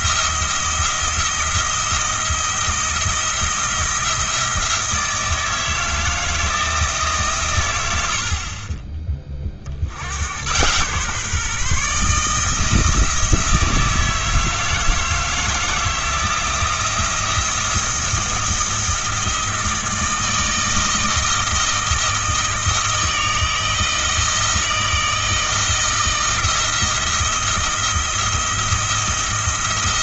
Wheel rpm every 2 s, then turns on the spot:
160, 170, 160, 160, 30, 120, 160, 160, 170, 170, 160, 160, 160, 160, 170.
none